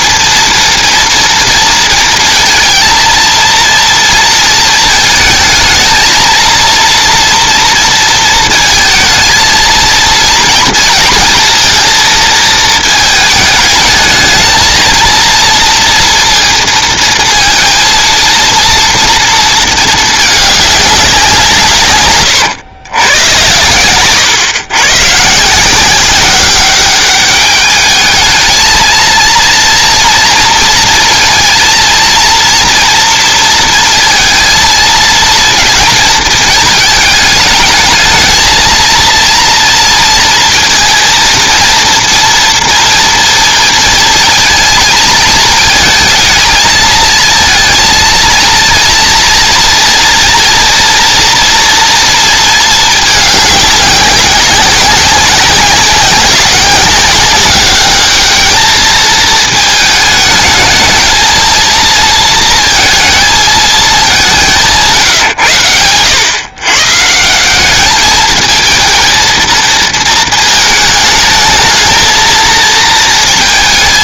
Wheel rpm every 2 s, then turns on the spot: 240, 230, 230, 230, 230, 230, 220, 220, 230, 230, 200, 110, 120, 190, 220, 230, 230, 230, 220, 230, 230, 230, 220, 220, 230, 230, 220, 190, 190, 220, 220, 220, 160, 130, 220, 220, 230.
none